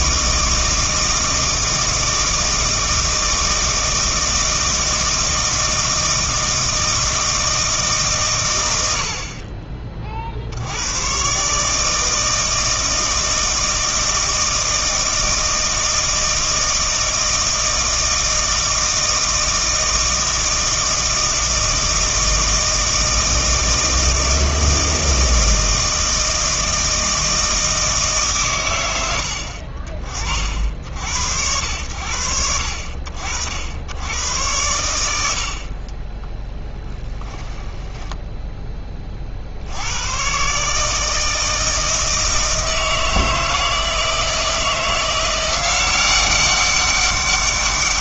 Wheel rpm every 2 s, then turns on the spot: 160, 160, 160, 160, 100, 70, 160, 160, 160, 160, 160, 160, 160, 160, 100, 60, 70, 110, 10, 20, 140, 160, 170, 190.
36-38